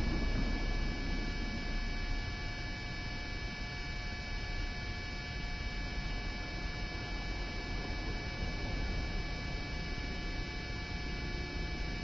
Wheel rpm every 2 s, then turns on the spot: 0, 0, 0, 0, 0, 0.
none